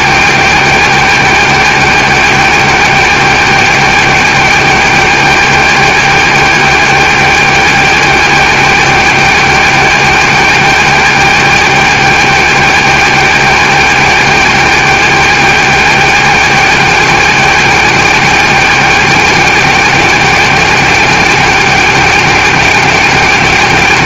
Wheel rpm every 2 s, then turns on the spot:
280, 280, 280, 280, 280, 280, 280, 280, 280, 280, 280, 280.
none